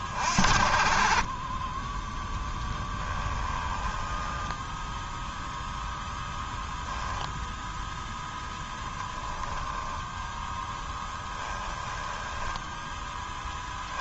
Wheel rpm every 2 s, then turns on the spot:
50, 10, 10, 0, 10, 10, 10.
2-6